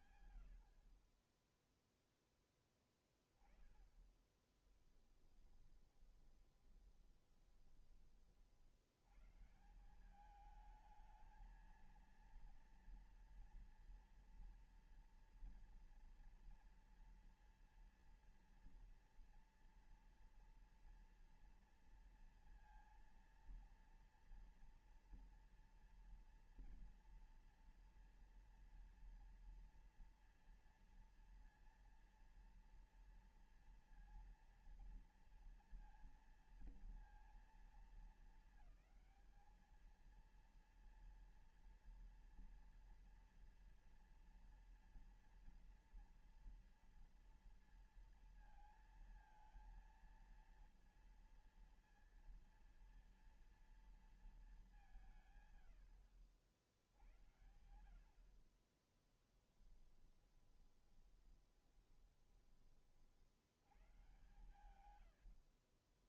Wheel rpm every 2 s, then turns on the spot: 40, 10, 20, 30, 100, 220, 230, 230, 240, 240, 230, 230, 230, 230, 230, 230, 230, 230, 230, 220, 230, 230, 230, 230, 230, 230, 230, 210, 80, 60, 20, 30, 120.
4-8 60-62 64-66